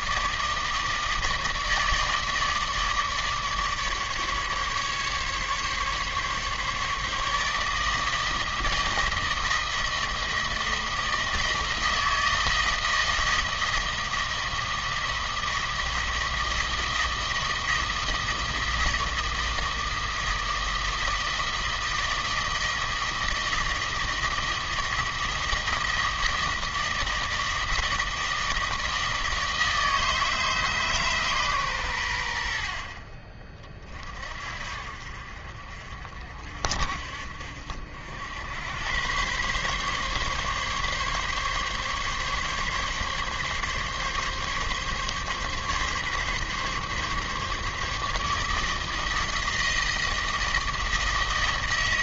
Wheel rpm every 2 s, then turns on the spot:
160, 150, 140, 150, 160, 160, 160, 160, 160, 160, 160, 160, 160, 160, 160, 140, 40, 60, 50, 110, 140, 140, 140, 140, 160, 160.
none